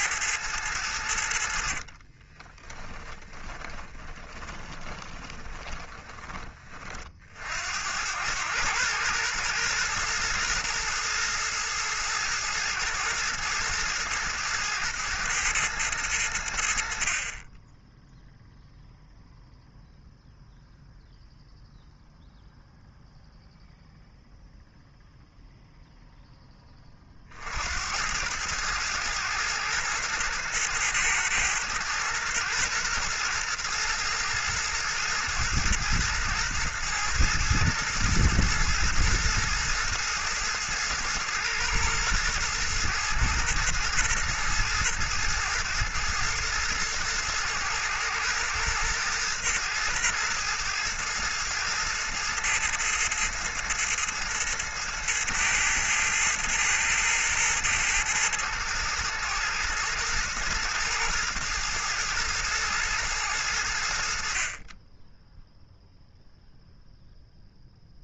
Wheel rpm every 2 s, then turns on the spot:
100, 20, 20, 40, 100, 110, 110, 110, 80, 0, 0, 0, 0, 20, 110, 110, 120, 110, 110, 110, 110, 110, 110, 110, 110, 110, 110, 110, 110, 110, 110, 110, 30, 0.
2-6